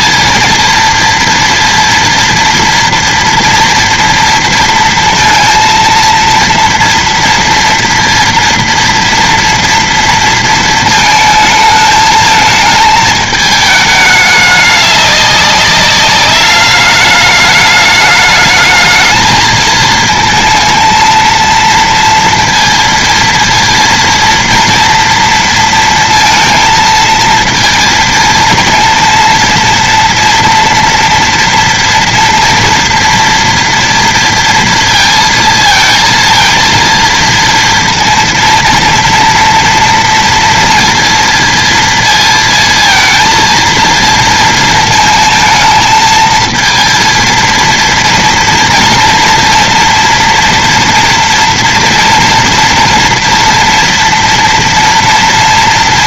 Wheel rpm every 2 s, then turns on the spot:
230, 230, 230, 230, 230, 220, 210, 200, 210, 220, 230, 230, 230, 230, 230, 230, 230, 230, 230, 230, 230, 220, 220, 230, 230, 230, 230, 230.
none